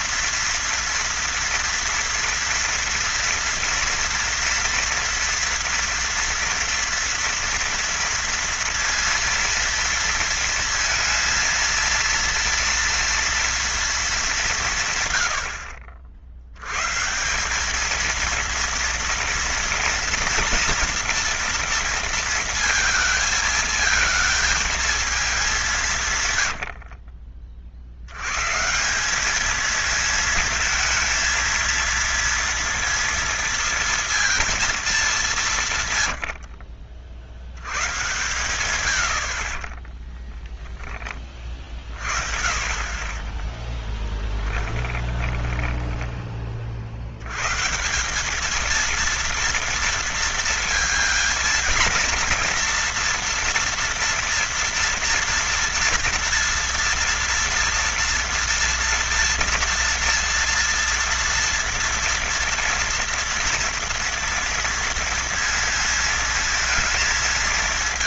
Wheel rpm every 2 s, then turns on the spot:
240, 230, 230, 230, 230, 230, 230, 130, 120, 230, 240, 230, 230, 70, 160, 220, 230, 220, 40, 90, 20, 40, 30, 60, 220, 230, 230, 230, 230, 240, 230, 230, 230, 220.
26-28 36-38 44-46